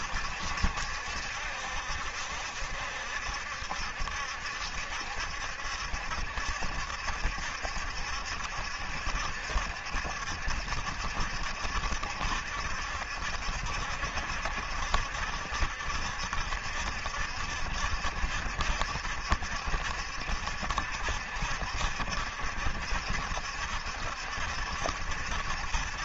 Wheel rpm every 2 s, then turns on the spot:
70, 70, 70, 70, 70, 70, 70, 70, 70, 70, 70, 60, 70.
none